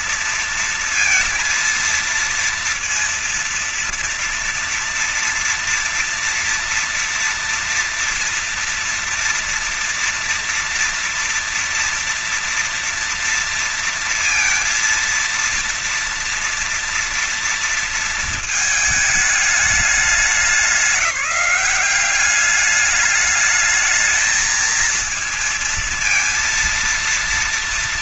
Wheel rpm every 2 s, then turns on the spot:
230, 230, 230, 230, 230, 230, 230, 230, 230, 220, 200, 200, 220, 230.
none